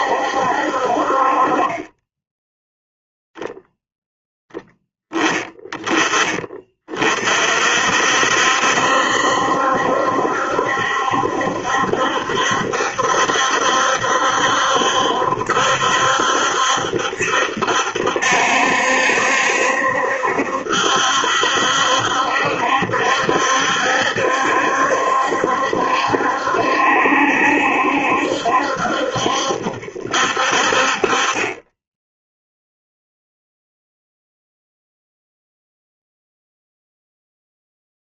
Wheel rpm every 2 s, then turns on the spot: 60, 10, 10, 30, 70, 70, 70, 70, 70, 70, 70, 70, 70, 70, 70, 50, 0, 0, 0.
none